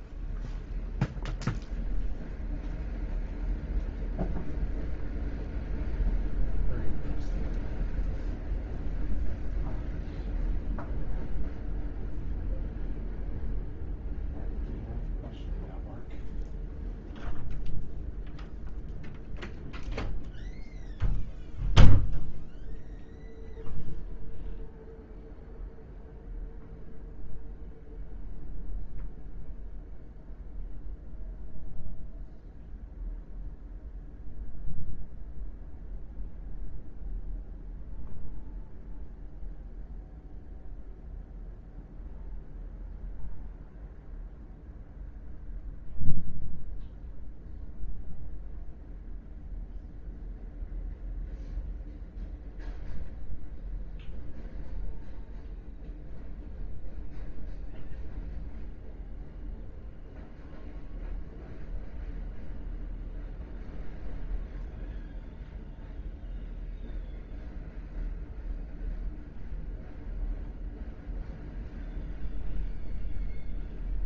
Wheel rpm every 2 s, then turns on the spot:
0, 0, 0, 0, 0, 0, 0, 0, 0, 0, 0, 0, 0, 0, 0, 0, 0, 0, 0, 0, 0, 0, 0, 0, 0, 0, 0, 0, 0, 0, 0, 0, 0, 0, 0, 0, 0.
none